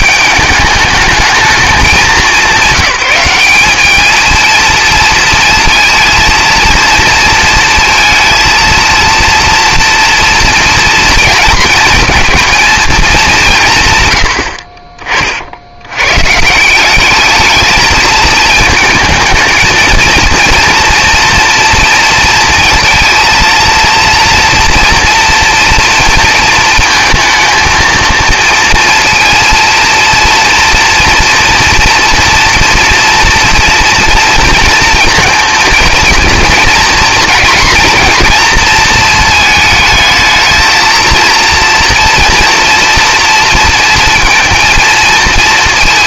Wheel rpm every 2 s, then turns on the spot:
210, 190, 230, 230, 230, 230, 230, 50, 160, 220, 230, 230, 230, 230, 230, 230, 230, 230, 230, 220, 220, 230, 230.
none